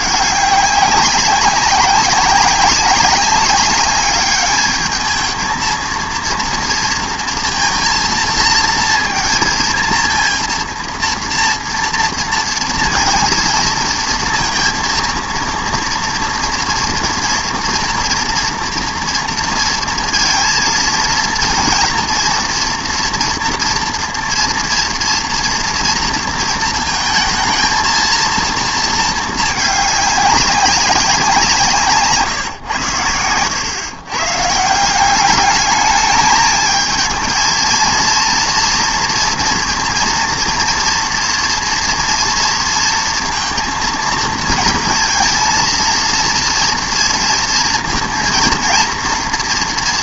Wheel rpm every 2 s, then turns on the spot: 200, 200, 210, 230, 230, 230, 230, 230, 230, 230, 230, 240, 230, 230, 230, 200, 120, 150, 220, 230, 230, 230, 230, 230, 230.
none